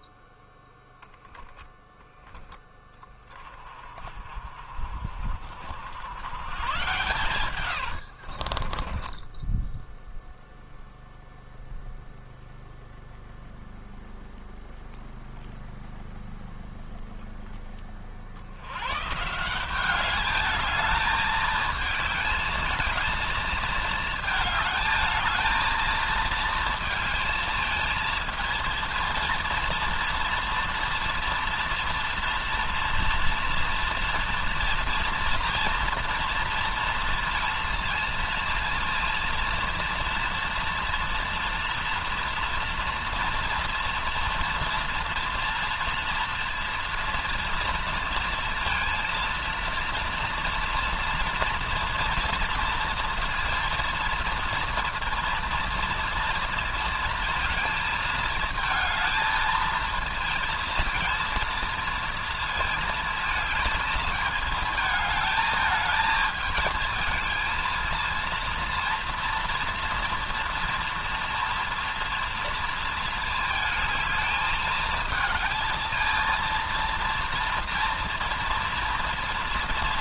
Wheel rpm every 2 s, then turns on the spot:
0, 20, 30, 110, 30, 0, 0, 0, 0, 100, 220, 220, 220, 220, 230, 230, 230, 230, 230, 230, 240, 230, 230, 230, 230, 230, 230, 230, 230, 220, 230, 220, 220, 220, 230, 230, 230, 220, 230, 230.
8-10